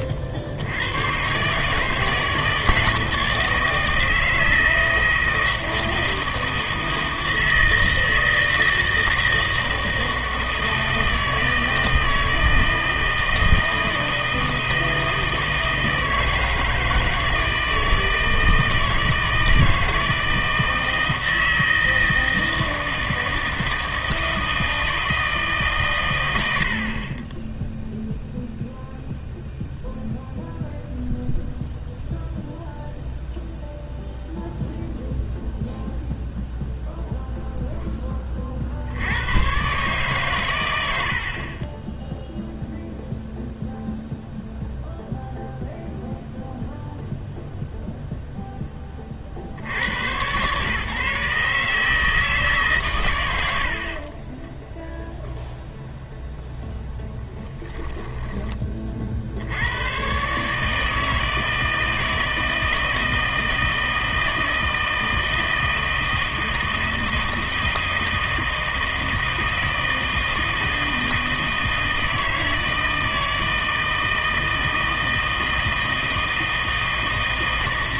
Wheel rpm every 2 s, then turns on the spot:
80, 160, 160, 160, 160, 160, 160, 160, 160, 160, 160, 160, 160, 60, 0, 0, 0, 0, 0, 50, 100, 0, 0, 0, 10, 130, 140, 0, 0, 30, 150, 160, 160, 160, 160, 160, 160, 160, 160.
none